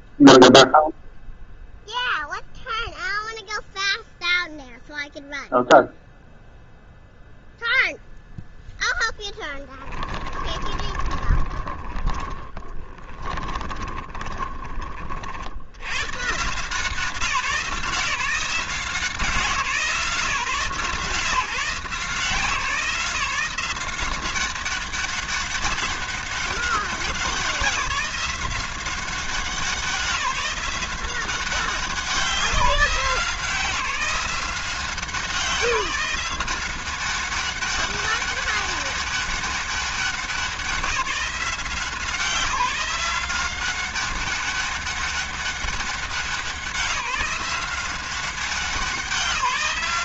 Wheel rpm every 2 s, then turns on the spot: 0, 0, 0, 0, 0, 20, 20, 30, 160, 180, 150, 170, 190, 200, 190, 180, 180, 170, 180, 200, 170, 180, 200, 180, 190.
10-14